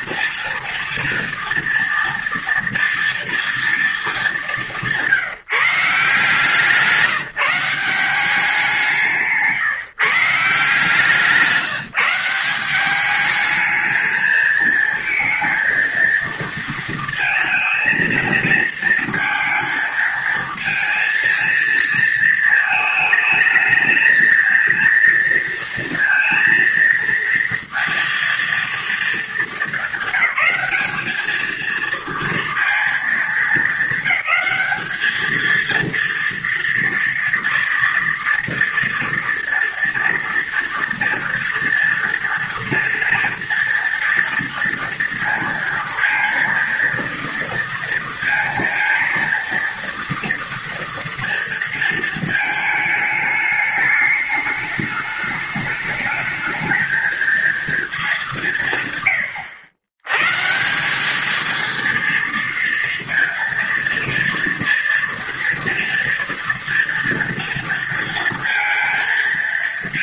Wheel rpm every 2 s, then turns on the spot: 230, 230, 200, 160, 180, 150, 190, 220, 230, 230, 230, 220, 220, 230, 230, 200, 230, 200, 230, 230, 230, 230, 230, 230, 230, 240, 220, 210, 220, 190, 150, 230, 230, 230, 230.
none